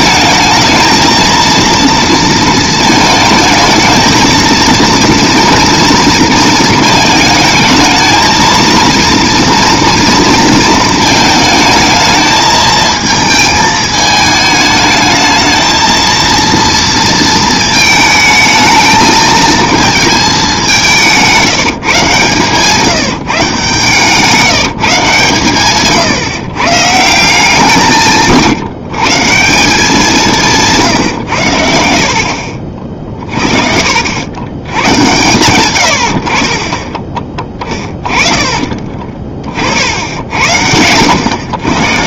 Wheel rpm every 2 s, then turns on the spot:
220, 220, 220, 220, 230, 230, 220, 210, 230, 220, 200, 140, 160, 140, 150, 160, 50, 100, 40, 30, 80.
none